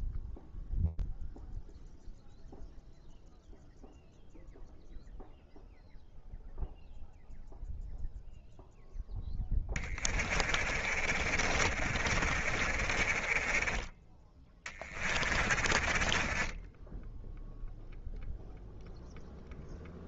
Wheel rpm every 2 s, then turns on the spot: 0, 0, 0, 0, 0, 30, 50, 30, 20, 0.
10-18